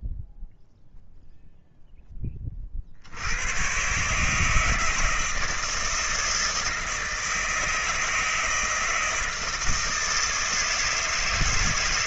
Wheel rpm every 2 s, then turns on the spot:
0, 50, 160, 160, 160, 150.
none